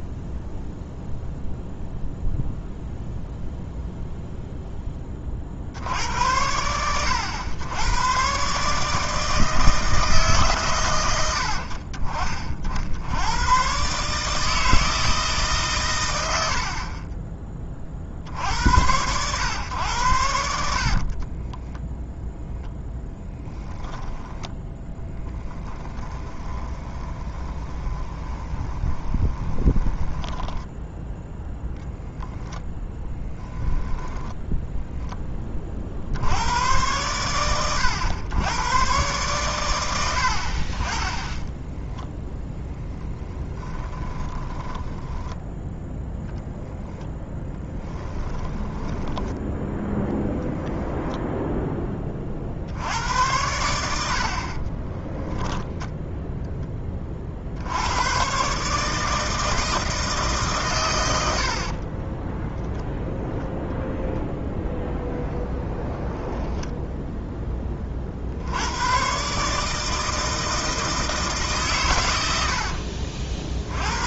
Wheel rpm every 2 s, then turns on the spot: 0, 0, 0, 90, 140, 130, 50, 160, 60, 70, 60, 0, 0, 20, 20, 10, 0, 0, 100, 110, 50, 10, 10, 0, 10, 0, 60, 40, 10, 140, 140, 0, 0, 10, 90, 160, 70.
26-32 44-46 48-50 66-68 72-74